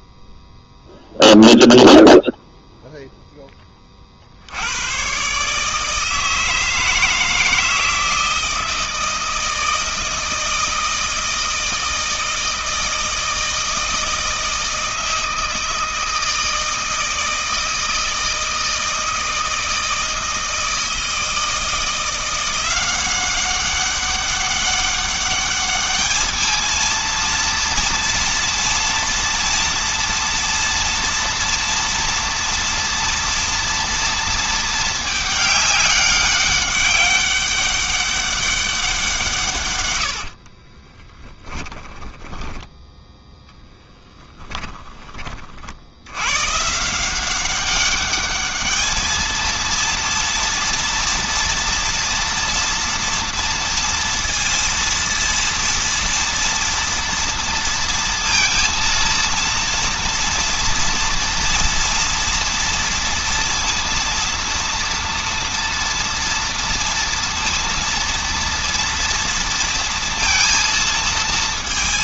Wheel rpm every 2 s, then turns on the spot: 0, 0, 120, 160, 160, 160, 160, 160, 160, 160, 160, 190, 200, 230, 230, 240, 230, 210, 200, 170, 20, 10, 20, 180, 220, 230, 230, 230, 230, 230, 230, 230, 230, 230, 230, 230.
40-42